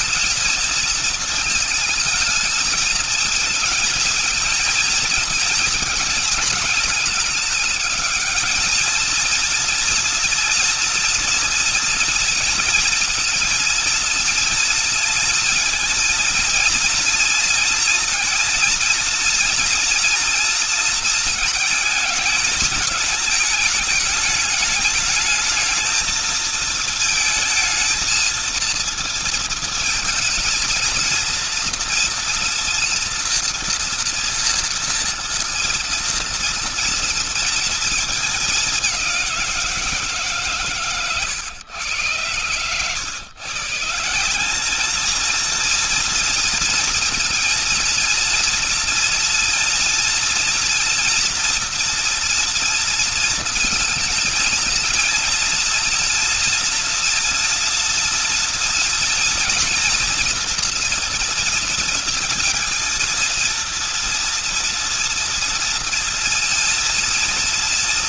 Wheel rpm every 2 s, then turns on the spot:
230, 220, 220, 220, 220, 230, 230, 230, 230, 230, 230, 220, 210, 220, 230, 230, 230, 230, 230, 220, 150, 110, 180, 230, 230, 230, 230, 230, 240, 230, 240, 230, 230, 230.
none